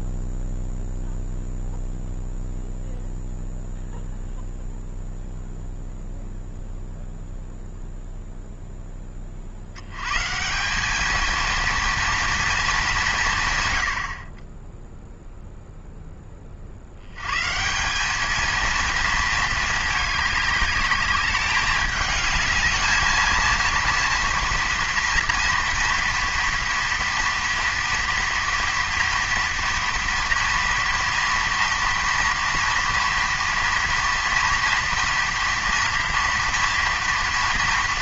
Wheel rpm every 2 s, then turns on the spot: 0, 0, 0, 0, 0, 160, 220, 30, 20, 220, 210, 220, 230, 240, 230, 230, 240, 230, 230.
none